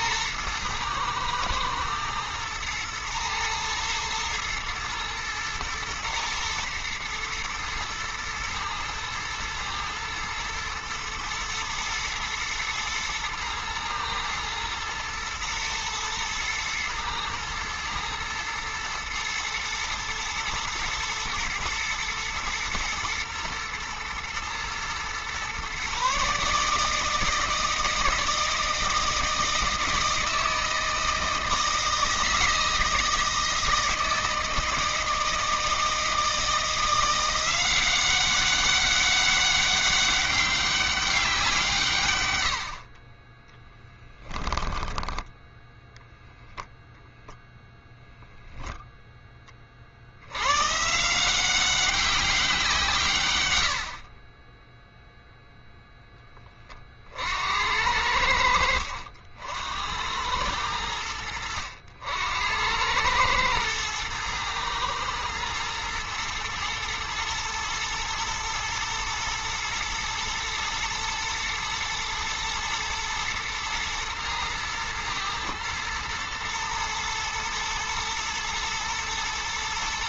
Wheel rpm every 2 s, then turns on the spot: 110, 110, 110, 120, 120, 120, 120, 110, 110, 110, 120, 110, 110, 150, 160, 160, 160, 160, 170, 190, 200, 70, 10, 0, 0, 130, 170, 10, 40, 80, 100, 90, 110, 110, 110, 110, 110, 110, 110, 110.
54-56